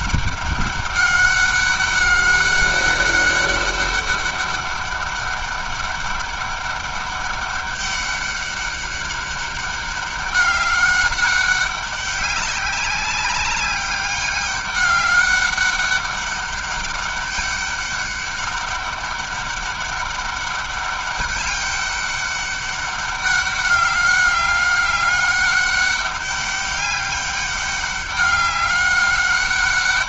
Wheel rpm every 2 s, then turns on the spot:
200, 200, 200, 200, 200, 200, 190, 200, 200, 200, 200, 200, 200, 200, 200.
none